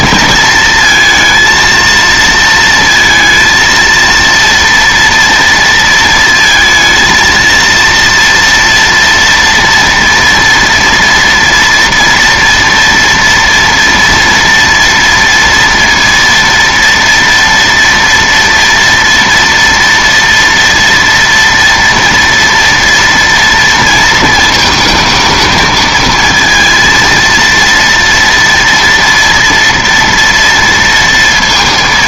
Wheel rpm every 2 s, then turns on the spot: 220, 230, 230, 220, 230, 230, 230, 230, 230, 230, 230, 230, 220, 230, 230, 230.
none